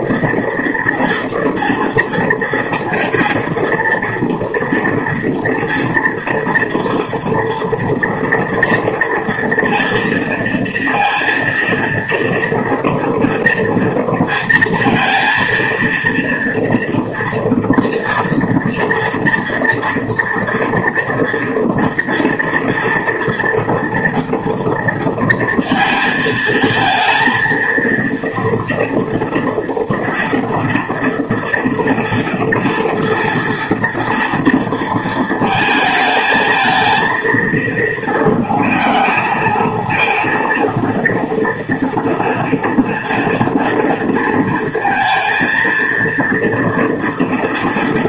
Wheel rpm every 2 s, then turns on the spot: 230, 230, 230, 230, 230, 230, 230, 230, 230, 230, 230, 230, 230, 220, 230, 230, 230, 230, 220, 220, 230, 230, 230, 230.
none